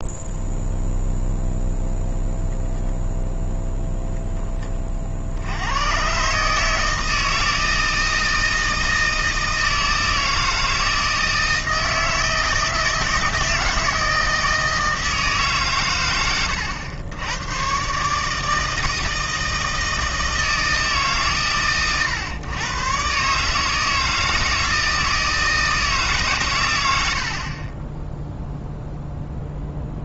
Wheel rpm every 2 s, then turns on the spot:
0, 0, 30, 160, 160, 160, 160, 160, 100, 160, 140, 130, 160, 90, 0.
none